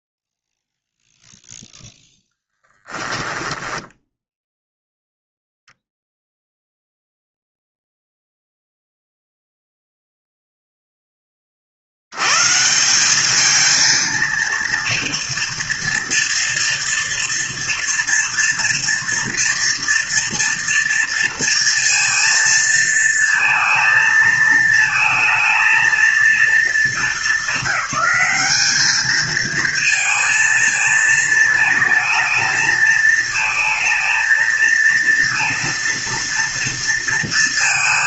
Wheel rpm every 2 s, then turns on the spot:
0, 10, 0, 0, 0, 0, 130, 230, 230, 240, 230, 230, 230, 220, 200, 220, 220, 220, 230.
2-4